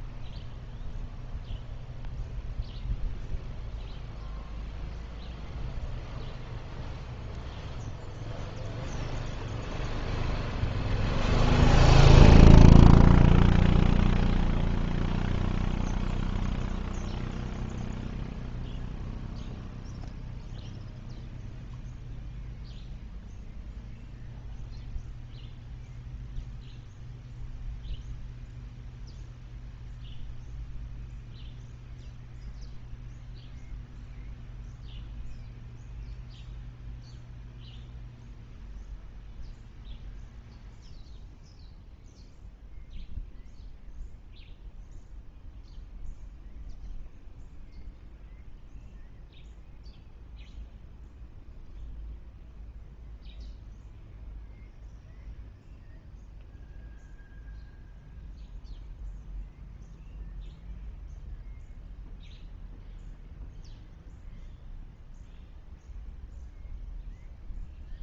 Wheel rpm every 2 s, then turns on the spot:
0, 0, 0, 0, 0, 0, 0, 0, 0, 0, 0, 0, 0, 0, 0, 0, 0, 0, 0, 0, 0, 0, 0, 0, 0, 0, 0, 0, 0, 0, 0, 0, 0, 0.
none